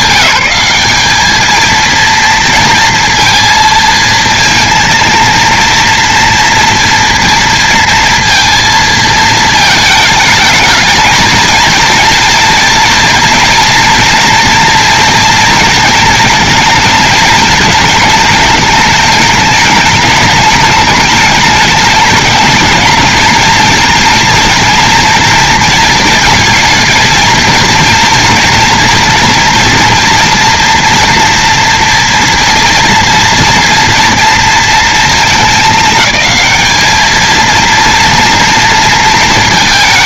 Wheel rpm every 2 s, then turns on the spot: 210, 230, 230, 230, 230, 220, 230, 230, 230, 220, 210, 220, 230, 230, 230, 230, 230, 230, 210, 230.
none